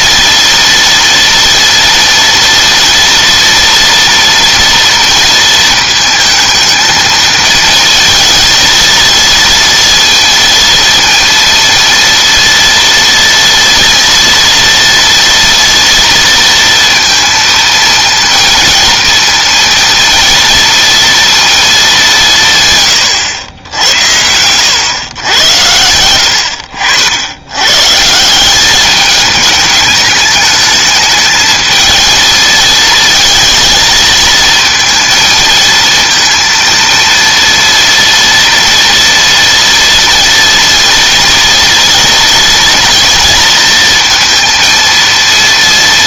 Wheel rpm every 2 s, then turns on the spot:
230, 230, 230, 220, 220, 230, 230, 230, 230, 230, 230, 140, 110, 70, 200, 210, 220, 230, 230, 230, 230, 230, 230.
none